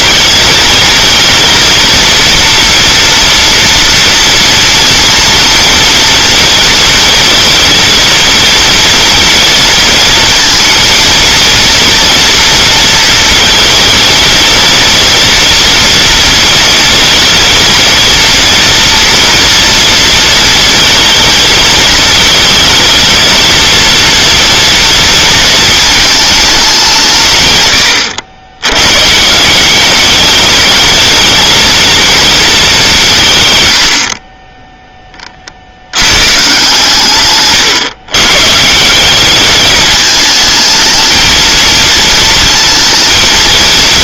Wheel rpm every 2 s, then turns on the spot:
230, 230, 230, 230, 230, 220, 230, 230, 230, 240, 230, 220, 230, 190, 110, 210, 190, 20, 140, 170, 220, 230.
none